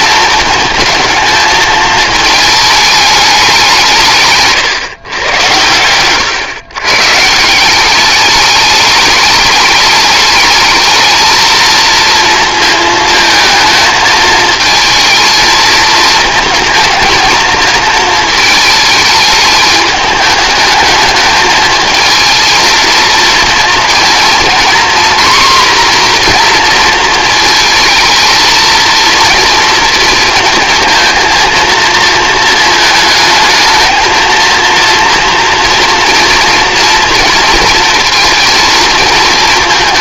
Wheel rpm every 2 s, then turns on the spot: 230, 220, 140, 120, 200, 210, 230, 220, 220, 220, 210, 220, 230, 240, 220, 230, 220, 220, 230, 220.
4-6